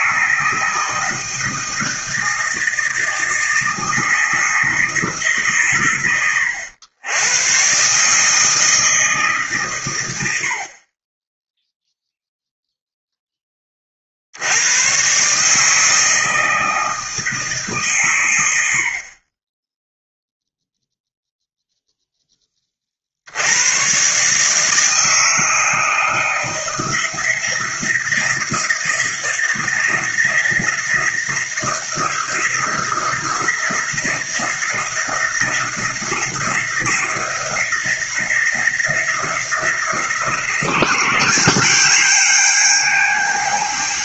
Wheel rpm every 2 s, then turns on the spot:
160, 160, 160, 100, 160, 50, 0, 110, 160, 70, 0, 30, 150, 160, 170, 170, 170, 170, 170, 170, 180, 210.
none